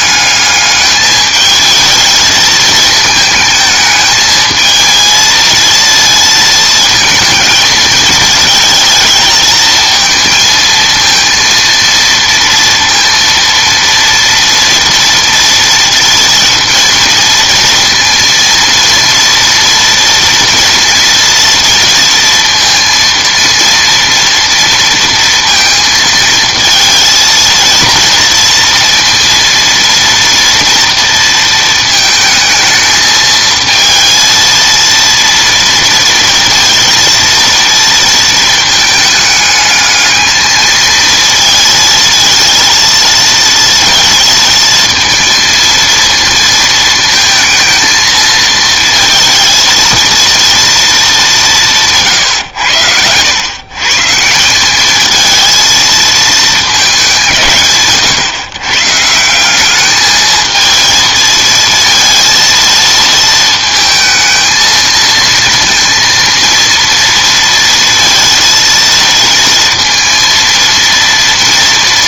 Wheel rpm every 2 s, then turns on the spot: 210, 220, 220, 230, 220, 230, 230, 230, 230, 230, 240, 230, 230, 220, 230, 230, 220, 230, 230, 220, 220, 230, 230, 230, 220, 230, 100, 190, 210, 130, 220, 230, 220, 230, 230, 230.
none